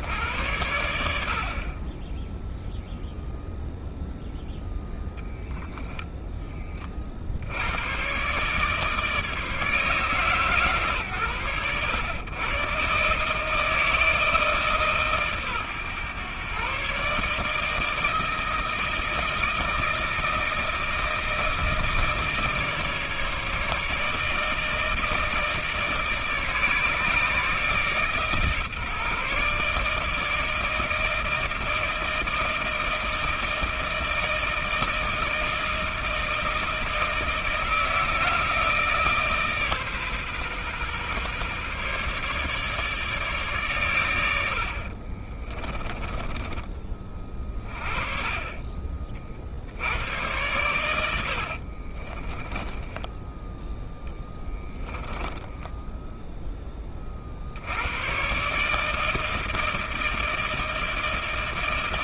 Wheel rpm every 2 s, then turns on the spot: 90, 0, 10, 30, 150, 130, 130, 150, 140, 160, 160, 160, 160, 150, 150, 160, 160, 160, 160, 160, 140, 150, 70, 30, 30, 100, 10, 10, 10, 150, 160.
44-46 50-56